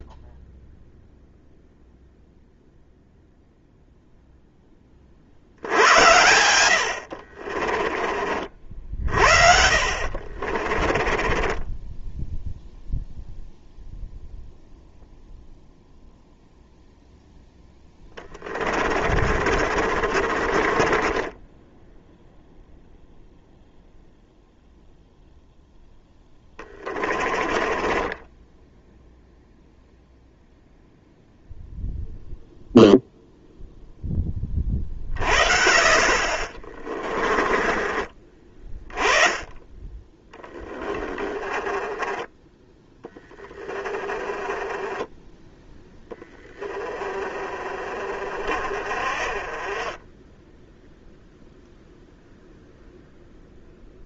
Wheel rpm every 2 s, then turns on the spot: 0, 0, 30, 70, 60, 30, 0, 0, 0, 40, 20, 0, 0, 20, 0, 0, 0, 40, 20, 20, 20, 10, 10, 20, 30, 0, 0.
6-8 10-12 18-22 26-28 36-38 40-42 48-50